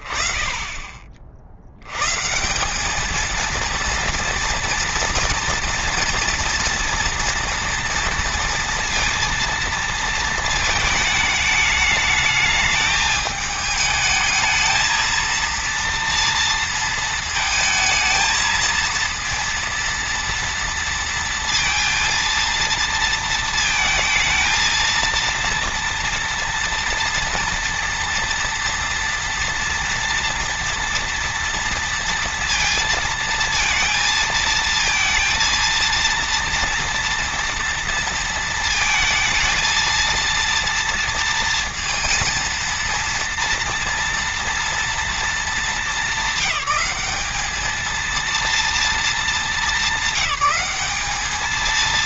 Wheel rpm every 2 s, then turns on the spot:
30, 200, 230, 230, 230, 220, 220, 220, 230, 230, 230, 230, 230, 240, 230, 230, 230, 230, 230, 230, 230, 230, 230, 200, 220, 200.
none